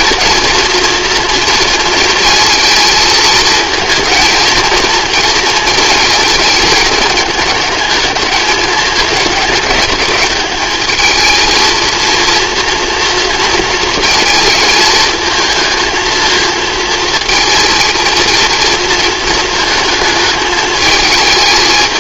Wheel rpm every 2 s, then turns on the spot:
240, 230, 230, 220, 210, 210, 240, 230, 230, 230, 220.
none